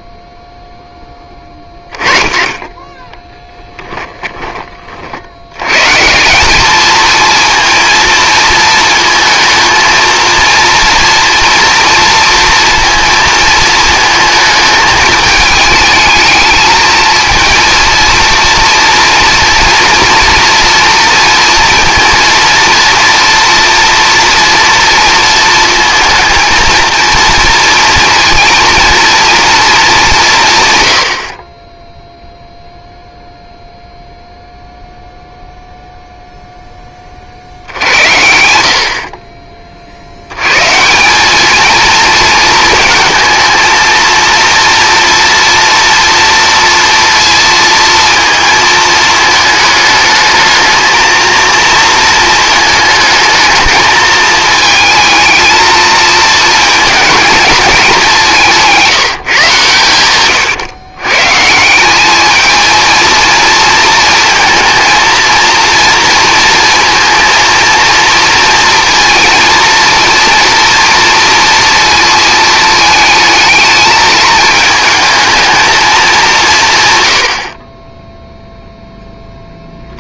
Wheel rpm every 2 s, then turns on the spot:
0, 20, 20, 190, 230, 230, 230, 220, 220, 230, 240, 230, 230, 230, 230, 160, 0, 0, 10, 80, 140, 220, 230, 230, 230, 220, 220, 220, 220, 180, 120, 220, 230, 230, 230, 230, 220, 220, 180, 0.
none